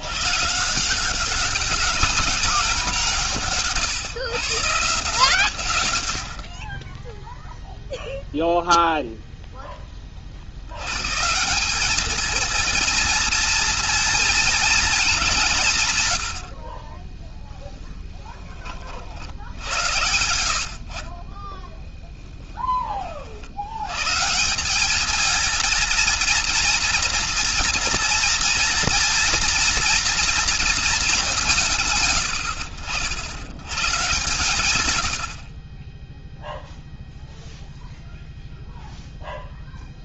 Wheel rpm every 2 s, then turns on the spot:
170, 170, 140, 20, 0, 130, 230, 210, 20, 60, 40, 40, 220, 240, 240, 210, 100, 90, 0, 0.
20-22